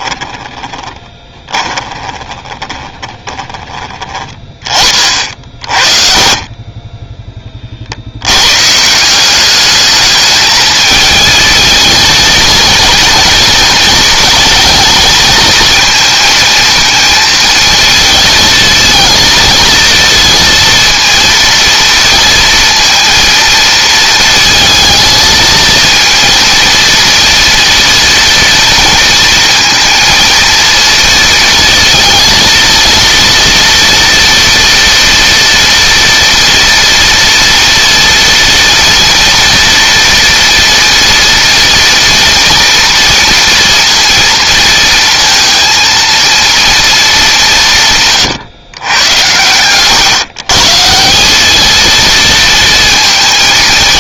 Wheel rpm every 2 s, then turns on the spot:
20, 20, 30, 20, 140, 220, 230, 220, 220, 230, 230, 230, 230, 230, 230, 230, 230, 230, 230, 230, 230, 230, 230, 230, 130, 150, 230.
0-4